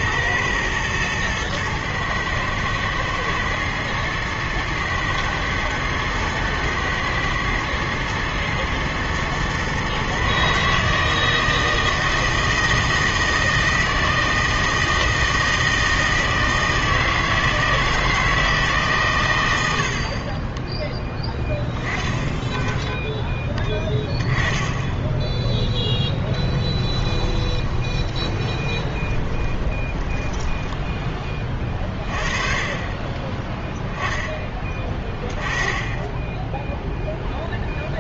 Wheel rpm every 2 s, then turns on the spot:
110, 110, 120, 110, 110, 150, 160, 160, 160, 150, 10, 10, 10, 10, 20, 10, 30, 20, 0.
26-30